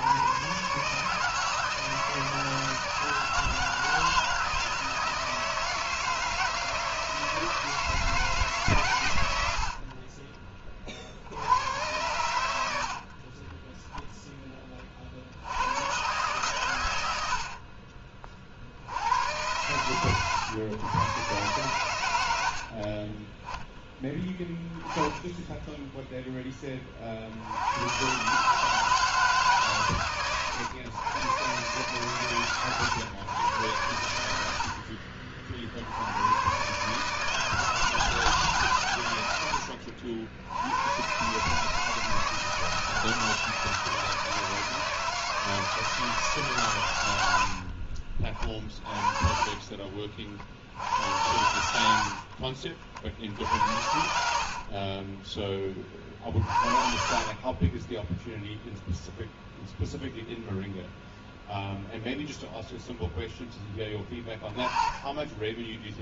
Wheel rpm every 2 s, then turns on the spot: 130, 160, 160, 160, 140, 20, 70, 20, 110, 60, 110, 60, 10, 20, 150, 110, 120, 80, 130, 140, 90, 160, 160, 130, 30, 60, 50, 50, 40, 0, 0, 0, 20.
none